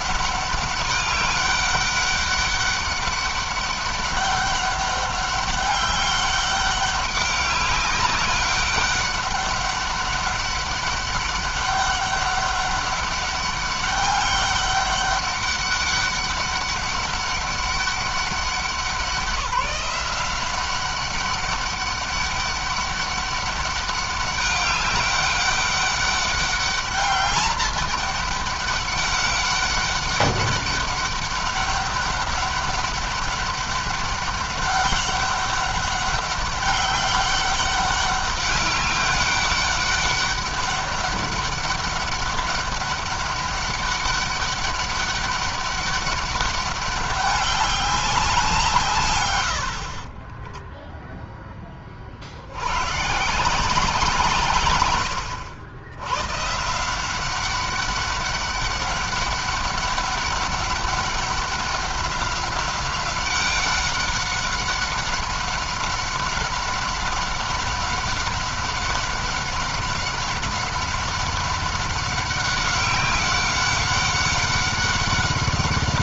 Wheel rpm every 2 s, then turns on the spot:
200, 200, 200, 200, 200, 200, 200, 200, 200, 190, 190, 200, 200, 200, 200, 200, 200, 200, 200, 200, 200, 200, 200, 200, 140, 0, 110, 120, 170, 200, 200, 190, 190, 190, 190, 190, 190, 190.
none